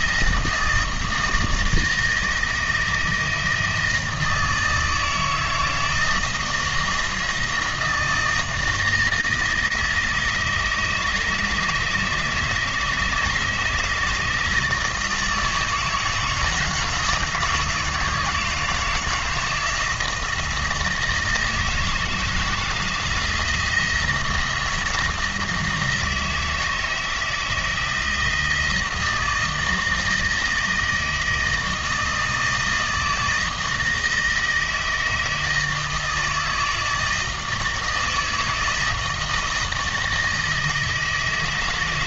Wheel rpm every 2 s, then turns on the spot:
160, 160, 160, 160, 160, 160, 160, 160, 170, 160, 160, 170, 170, 160, 160, 160, 160, 160, 160, 160, 160.
none